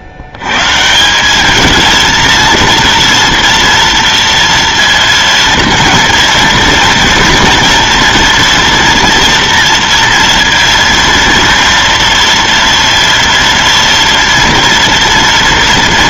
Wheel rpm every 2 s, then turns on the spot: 130, 230, 230, 230, 230, 230, 230, 230.
none